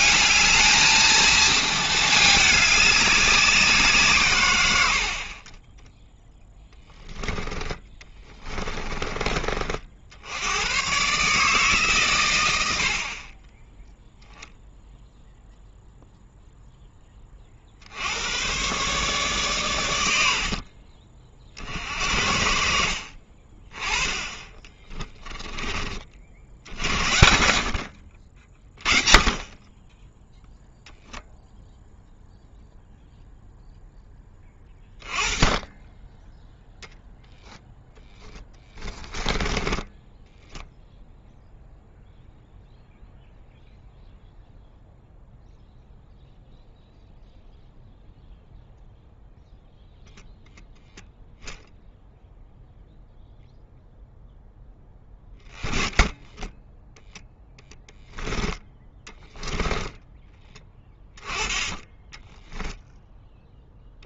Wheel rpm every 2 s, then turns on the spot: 220, 200, 100, 10, 20, 110, 70, 0, 0, 120, 40, 60, 20, 70, 30, 0, 0, 20, 0, 10, 0, 0, 0, 0, 0, 0, 0, 10, 10, 10, 20, 0.
8-10 24-26 38-40 56-60